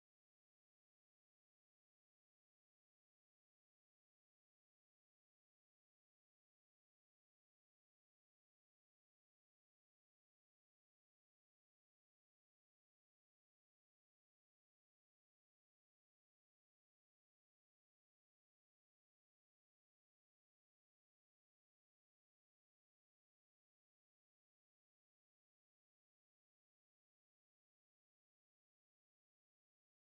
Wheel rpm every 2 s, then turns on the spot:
0, 0, 0, 0, 0, 0, 0, 0, 0, 0, 0, 0, 0, 0, 0.
none